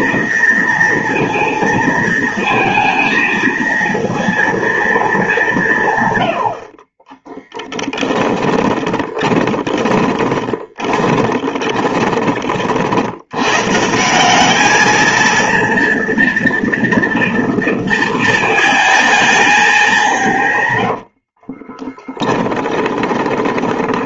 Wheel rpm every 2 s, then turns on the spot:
230, 230, 230, 80, 20, 20, 40, 200, 230, 220, 140, 20.
8-12 22-24